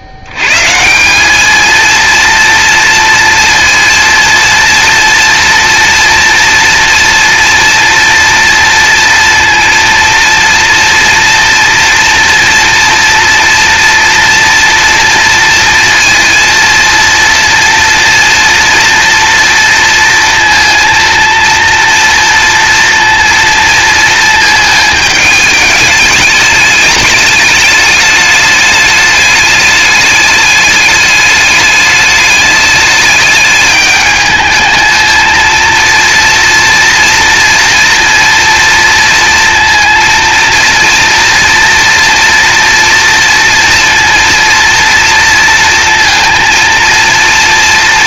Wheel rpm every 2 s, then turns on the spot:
80, 230, 230, 240, 230, 230, 230, 230, 230, 240, 230, 230, 220, 210, 210, 210, 210, 220, 240, 230, 230, 230, 230, 230.
none